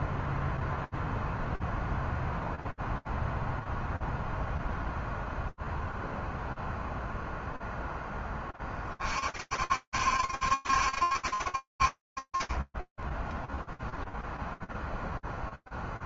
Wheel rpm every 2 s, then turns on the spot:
0, 0, 0, 0, 30, 70, 20, 0.
none